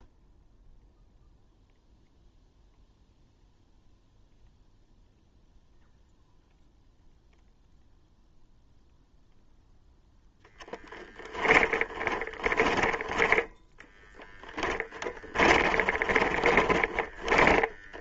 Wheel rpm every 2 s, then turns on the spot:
0, 0, 0, 0, 0, 10, 10, 20, 20.
10-18